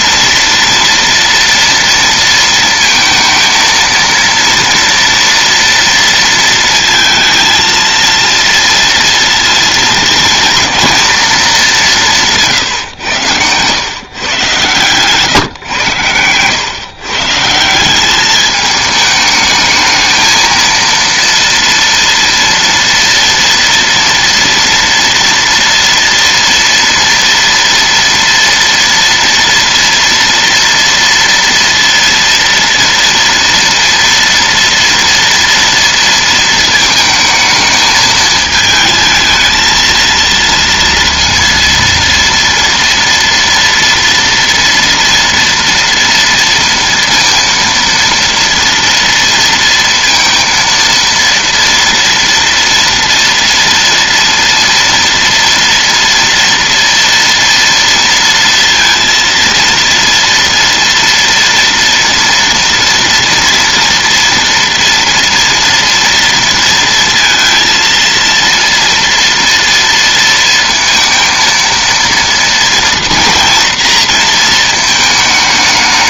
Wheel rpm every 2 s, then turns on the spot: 230, 230, 230, 230, 230, 230, 140, 130, 130, 210, 230, 230, 230, 230, 230, 230, 230, 230, 230, 220, 230, 230, 240, 230, 230, 230, 230, 230, 230, 230, 230, 230, 230, 230, 230, 230, 230, 220.
none